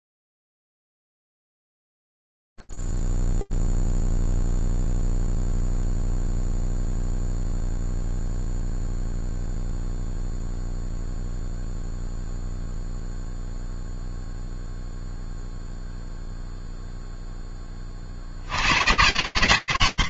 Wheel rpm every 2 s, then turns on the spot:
0, 0, 0, 0, 0, 0, 0, 0, 0, 80.
none